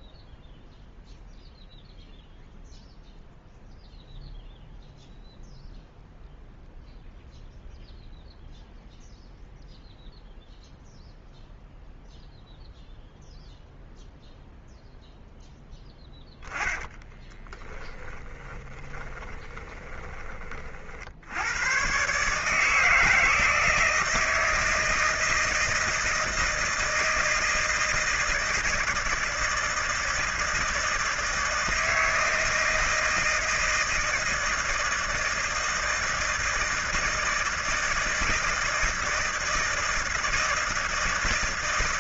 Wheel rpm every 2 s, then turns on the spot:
0, 0, 0, 0, 0, 0, 0, 0, 10, 20, 40, 150, 160, 160, 160, 160, 160, 160, 160, 160, 160.
16-20